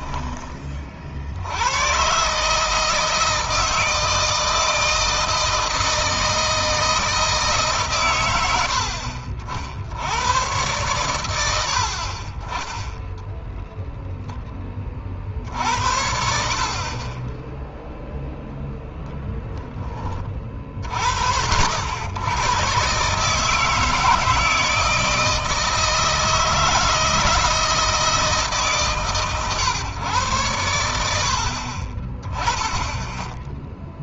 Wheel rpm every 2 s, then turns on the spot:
50, 160, 160, 160, 70, 110, 0, 30, 30, 0, 40, 130, 160, 160, 140, 70, 10.
none